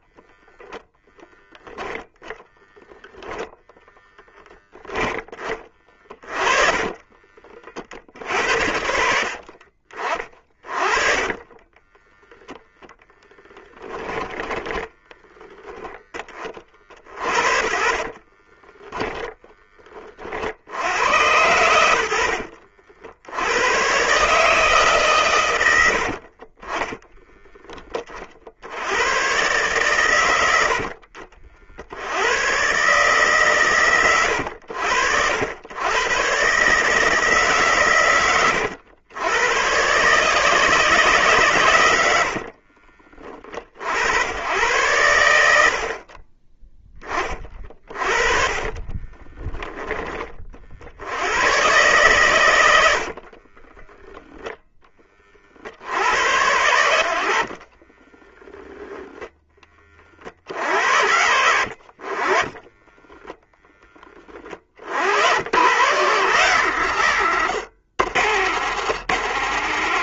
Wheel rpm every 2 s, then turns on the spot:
0, 0, 10, 40, 70, 20, 10, 10, 40, 20, 90, 70, 140, 20, 100, 50, 140, 80, 160, 100, 150, 30, 100, 30, 30, 70, 70, 20, 70, 0, 70, 10, 70, 130, 120.
6-12 14-20 26-28 48-50 52-54 62-64